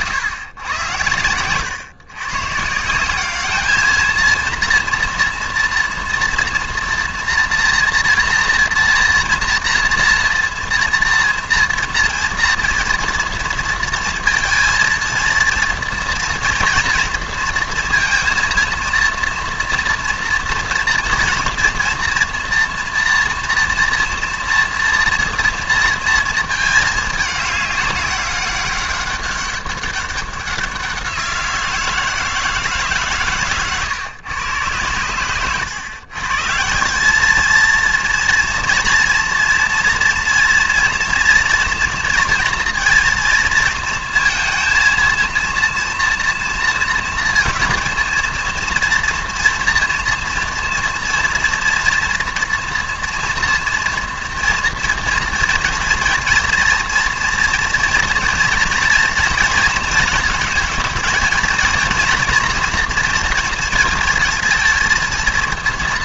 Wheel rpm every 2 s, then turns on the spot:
110, 140, 230, 230, 240, 230, 230, 230, 230, 230, 230, 230, 230, 220, 200, 190, 160, 120, 150, 230, 240, 240, 230, 230, 230, 230, 230, 230, 230, 230, 230, 230, 230.
none